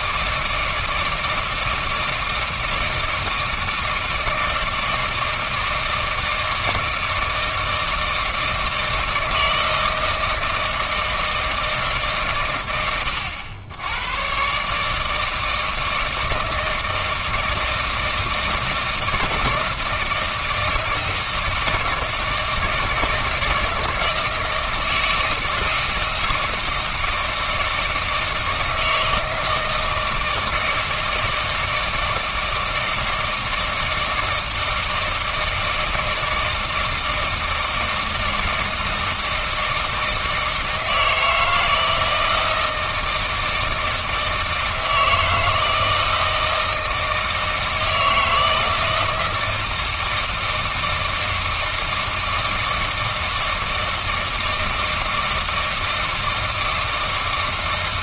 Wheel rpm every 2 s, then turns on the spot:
160, 160, 160, 160, 160, 160, 100, 140, 160, 160, 160, 160, 160, 160, 160, 160, 160, 160, 160, 160, 160, 160, 160, 160, 160, 160, 160, 160, 160.
none